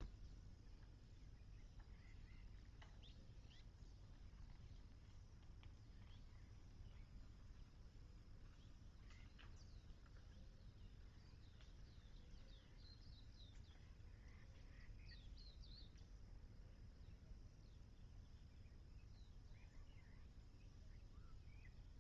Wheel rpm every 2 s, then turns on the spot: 0, 0, 0, 0, 0, 0, 0, 0, 0, 0, 0.
none